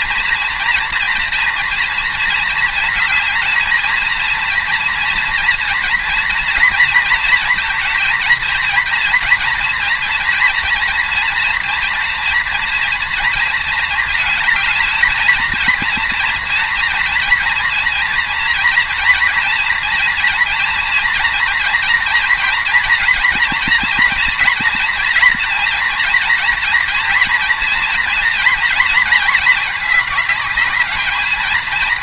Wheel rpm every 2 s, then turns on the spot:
240, 230, 230, 230, 230, 230, 230, 220, 240, 230, 230, 230, 230, 240, 230, 210.
none